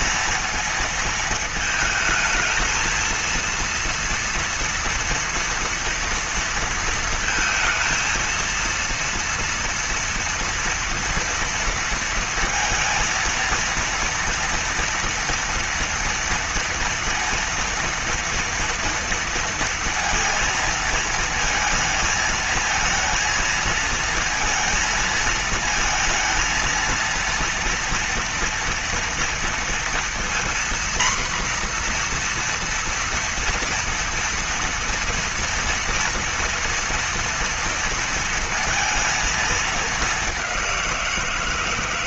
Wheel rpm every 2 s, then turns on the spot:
230, 230, 230, 230, 230, 230, 230, 240, 230, 230, 230, 220, 230, 230, 230, 240, 240, 230, 230, 230, 190.
none